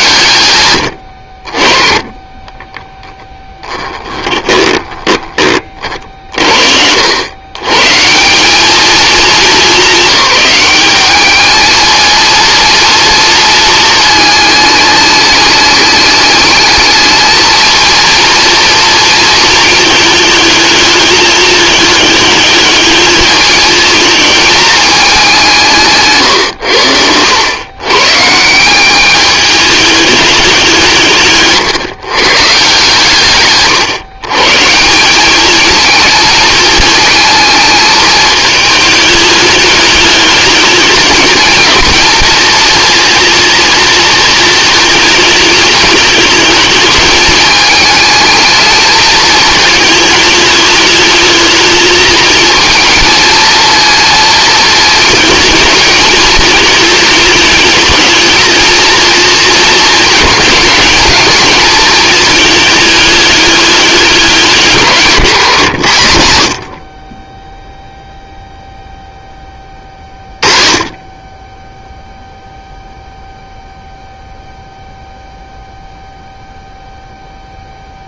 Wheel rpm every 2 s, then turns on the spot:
90, 10, 20, 80, 210, 200, 230, 210, 210, 230, 220, 210, 210, 90, 190, 160, 130, 180, 220, 220, 210, 230, 220, 220, 220, 210, 230, 220, 220, 220, 210, 210, 190, 30, 0, 20, 0, 0, 0.
2-6